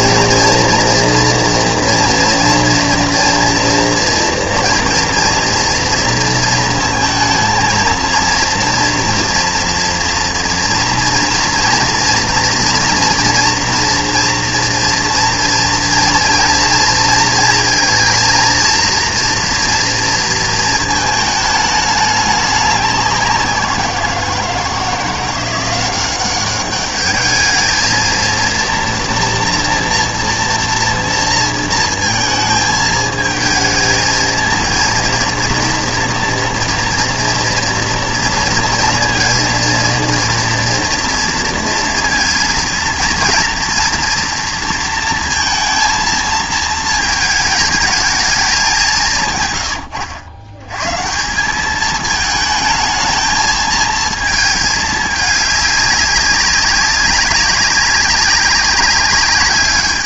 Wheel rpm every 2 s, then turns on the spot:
230, 230, 230, 220, 240, 230, 230, 230, 230, 230, 220, 200, 170, 200, 230, 230, 220, 230, 240, 230, 230, 230, 230, 220, 180, 120, 220, 210, 200, 200.
none